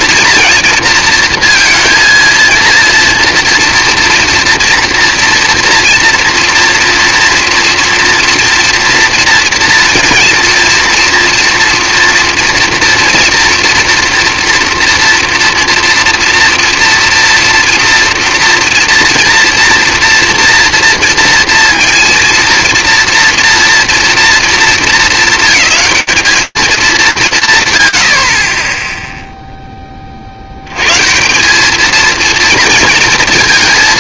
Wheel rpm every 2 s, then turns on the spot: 230, 230, 230, 240, 230, 230, 230, 230, 230, 230, 230, 230, 230, 210, 90, 40, 220.
none